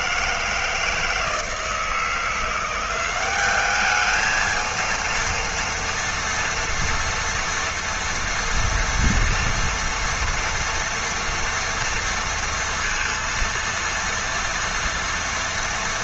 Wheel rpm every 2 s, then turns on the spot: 160, 190, 230, 230, 230, 230, 230, 230.
none